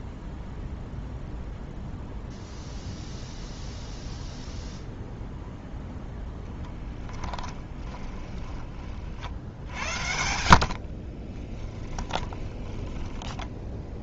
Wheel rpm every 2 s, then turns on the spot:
0, 0, 0, 10, 40, 60, 20.
6-8 10-14